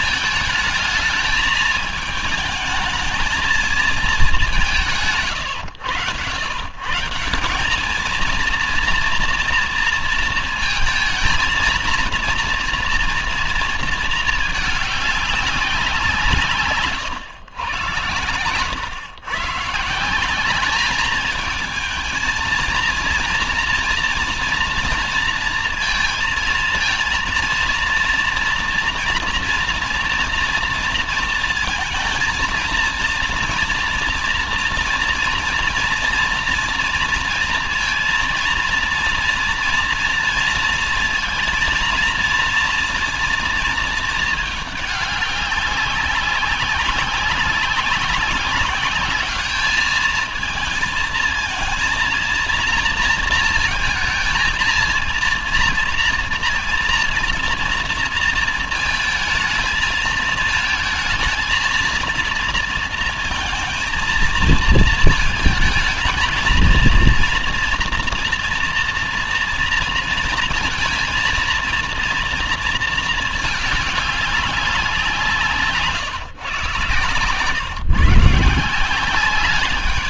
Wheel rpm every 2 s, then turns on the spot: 220, 220, 130, 160, 230, 230, 230, 210, 130, 120, 210, 230, 230, 230, 230, 230, 230, 230, 230, 230, 230, 230, 200, 200, 200, 220, 230, 230, 230, 220, 220, 230, 220, 230, 230, 230, 230, 180, 140, 180.
none